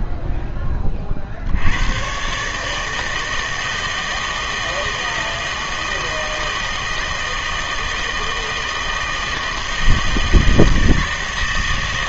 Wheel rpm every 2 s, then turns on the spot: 20, 150, 160, 160, 160, 160.
none